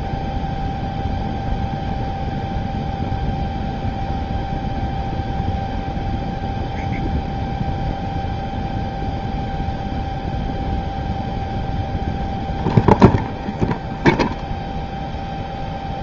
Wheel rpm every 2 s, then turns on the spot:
0, 0, 0, 0, 0, 0, 0, 0.
none